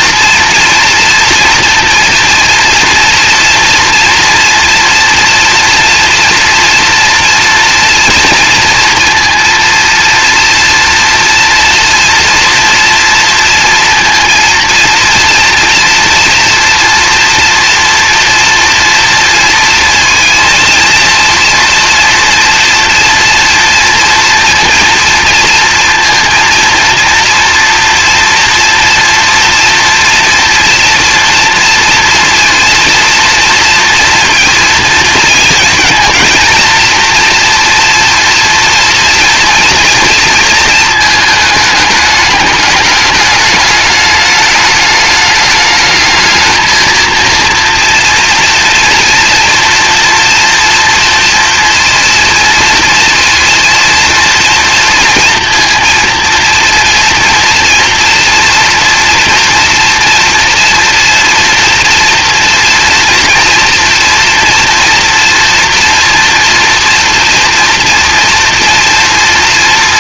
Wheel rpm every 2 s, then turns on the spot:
230, 230, 230, 230, 230, 230, 230, 230, 230, 230, 230, 230, 230, 230, 230, 230, 240, 230, 230, 230, 230, 210, 210, 220, 230, 230, 230, 230, 230, 230, 230, 230, 230, 230, 230.
none